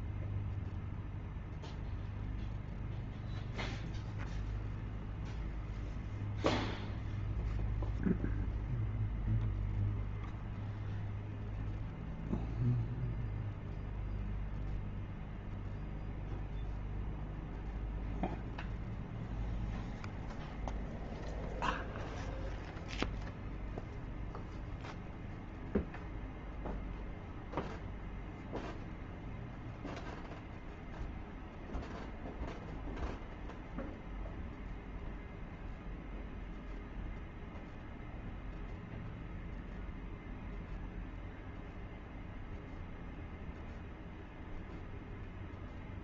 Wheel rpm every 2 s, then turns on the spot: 0, 0, 0, 0, 0, 0, 0, 0, 0, 0, 0, 0, 0, 0, 0, 0, 0, 0, 0, 0, 0, 0, 0.
none